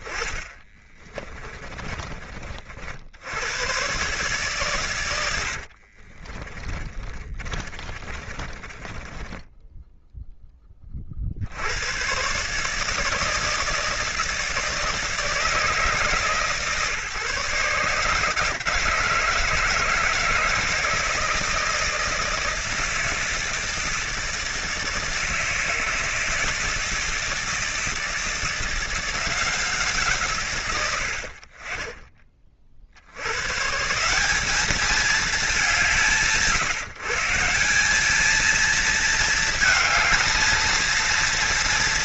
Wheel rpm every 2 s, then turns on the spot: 10, 30, 130, 40, 30, 10, 110, 160, 150, 150, 160, 160, 160, 160, 160, 150, 30, 170, 160, 210, 220.
0-2 6-10